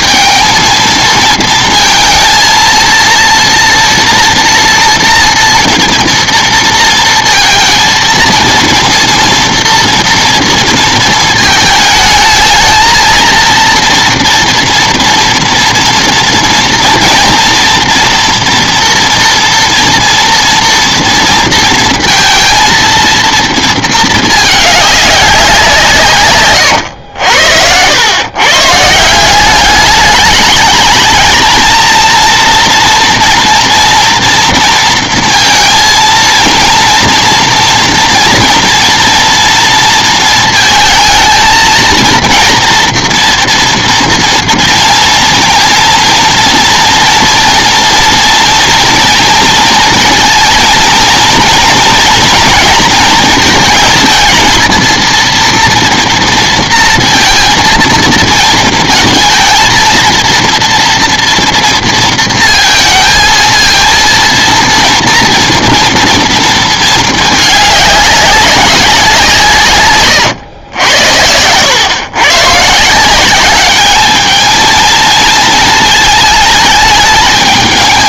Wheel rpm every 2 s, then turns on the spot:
220, 230, 230, 230, 230, 230, 220, 240, 230, 230, 240, 230, 210, 120, 130, 210, 230, 230, 230, 230, 220, 230, 230, 230, 230, 230, 230, 220, 230, 220, 230, 230, 230, 220, 200, 100, 140, 220, 220.
none